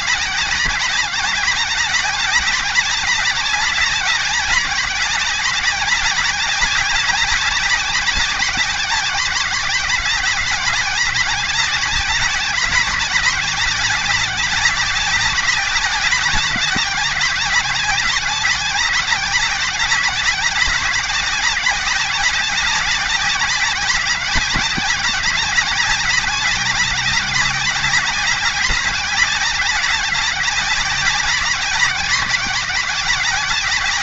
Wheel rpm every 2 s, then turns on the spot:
200, 190, 190, 190, 190, 180, 190, 190, 190, 190, 190, 190, 180, 190, 190, 190, 180.
none